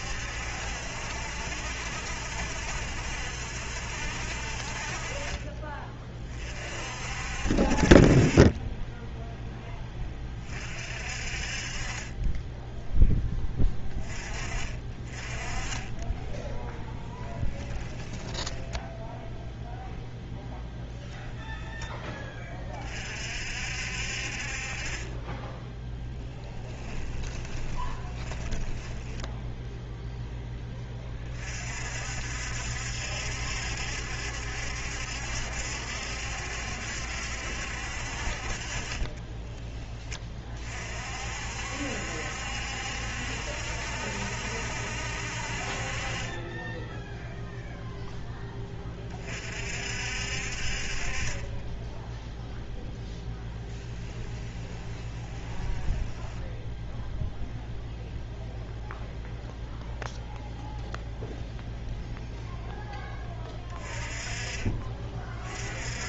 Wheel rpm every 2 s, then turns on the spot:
70, 70, 40, 50, 10, 40, 10, 30, 10, 20, 0, 30, 40, 20, 20, 20, 70, 70, 70, 30, 40, 70, 60, 10, 20, 40, 0, 20, 0, 0, 0, 10, 30.
16-20 26-30 38-40 54-56